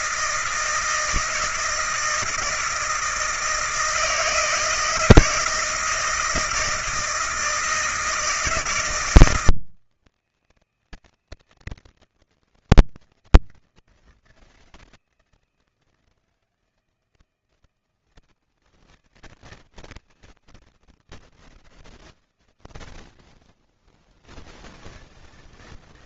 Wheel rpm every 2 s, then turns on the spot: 160, 160, 160, 160, 160, 160, 160, 160, 160, 160, 160, 80, 120.
none